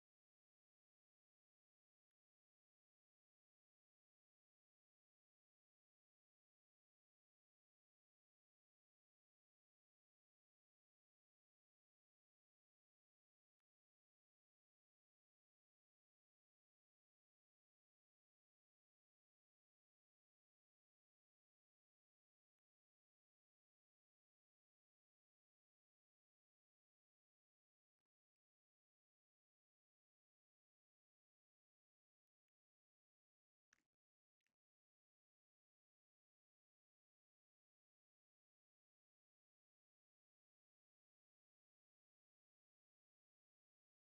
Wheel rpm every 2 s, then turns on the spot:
0, 0, 0, 0, 0, 0, 0, 0, 0, 0, 0, 0, 0, 0, 0, 0, 0, 0, 0, 0, 0, 0.
none